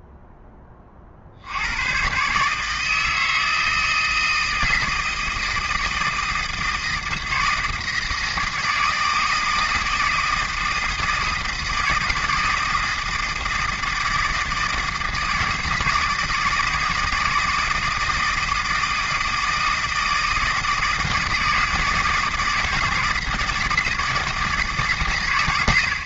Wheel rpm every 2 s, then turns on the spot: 20, 160, 160, 160, 160, 160, 160, 160, 160, 160, 160, 160, 140.
none